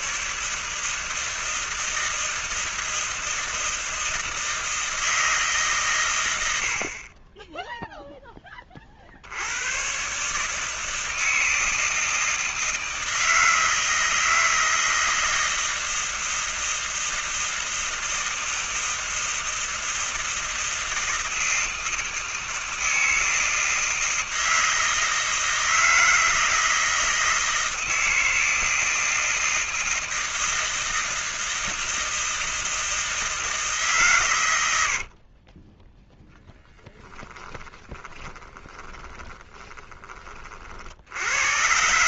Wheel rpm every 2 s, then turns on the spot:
160, 160, 160, 60, 20, 150, 160, 160, 160, 160, 160, 160, 160, 160, 160, 160, 160, 100, 10, 20, 60.
34-36 38-40